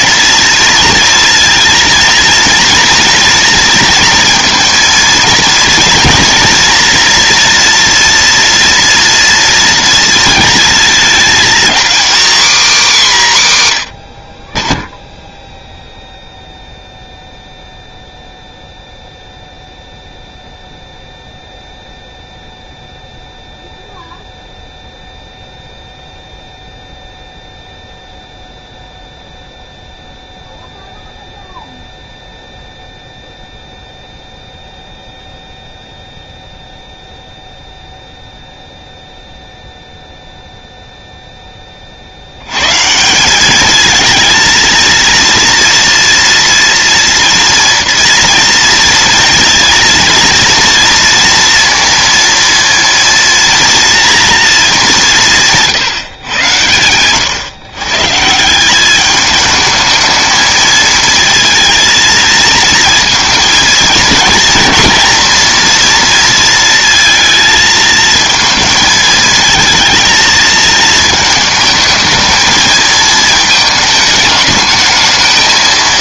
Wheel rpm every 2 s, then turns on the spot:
230, 230, 230, 230, 240, 230, 270, 30, 0, 0, 0, 0, 0, 0, 0, 0, 0, 0, 0, 0, 0, 100, 230, 230, 230, 240, 230, 220, 110, 170, 220, 220, 220, 230, 220, 220, 220, 210.
none